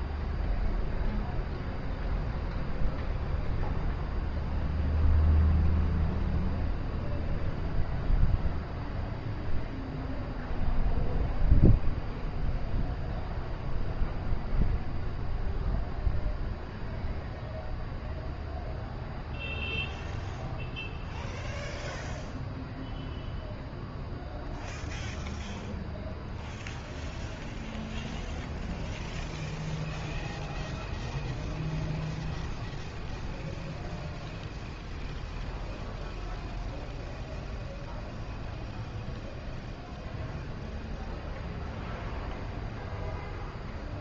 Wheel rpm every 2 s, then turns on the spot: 0, 0, 0, 0, 0, 0, 0, 0, 0, 0, 0, 0, 0, 0, 0, 0, 0, 0, 0, 0, 0, 0.
none